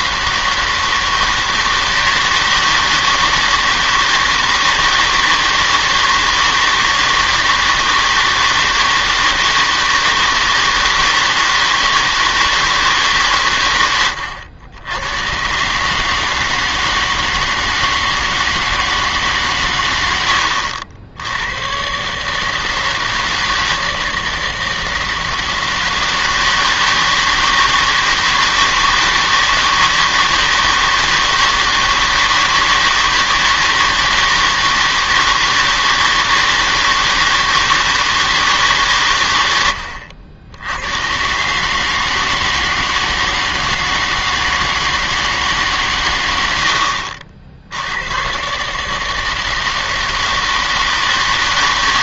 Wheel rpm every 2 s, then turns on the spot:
160, 160, 160, 160, 160, 160, 160, 90, 160, 160, 80, 160, 160, 160, 160, 160, 160, 160, 160, 150, 90, 160, 160, 70, 140, 160.
none